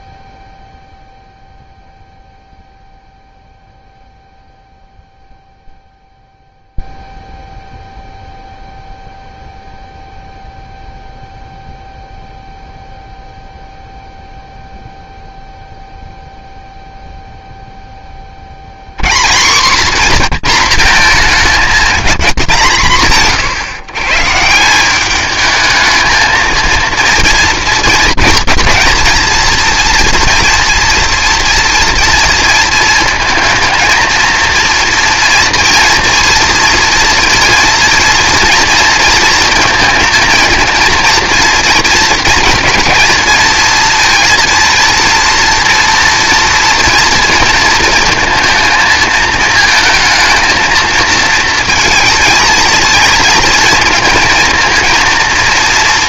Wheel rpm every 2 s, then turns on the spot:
0, 0, 0, 0, 0, 0, 0, 0, 0, 60, 220, 190, 170, 230, 230, 240, 230, 230, 230, 230, 230, 230, 230, 240, 220, 220, 230, 230.
none